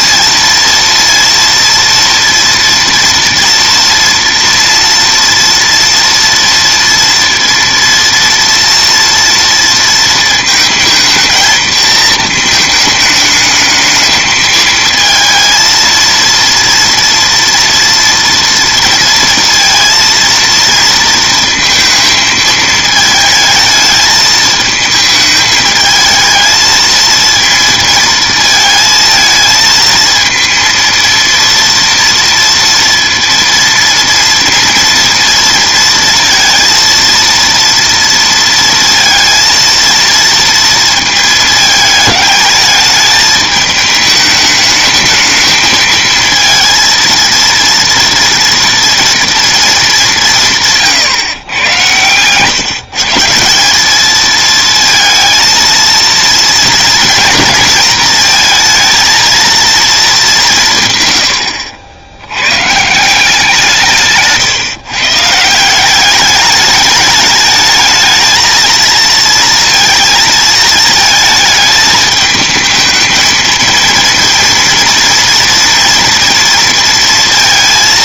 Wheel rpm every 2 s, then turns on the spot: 230, 230, 230, 230, 230, 220, 220, 220, 230, 230, 230, 220, 220, 220, 220, 230, 230, 230, 230, 230, 230, 210, 220, 230, 240, 150, 140, 220, 230, 230, 150, 150, 140, 210, 230, 220, 220, 230, 230.
none